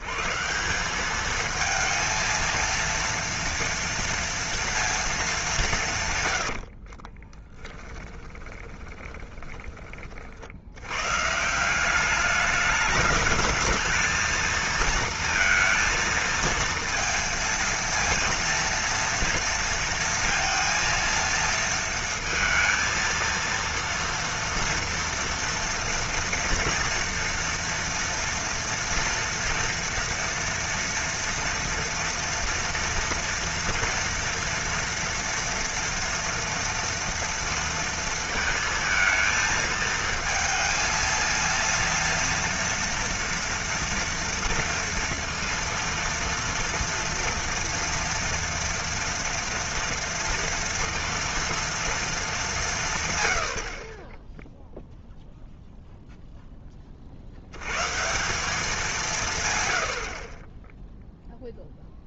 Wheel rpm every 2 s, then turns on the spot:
170, 230, 230, 70, 20, 90, 210, 230, 230, 230, 230, 230, 230, 240, 230, 230, 230, 230, 230, 230, 220, 240, 230, 230, 240, 230, 180, 0, 20, 200, 0.
6-10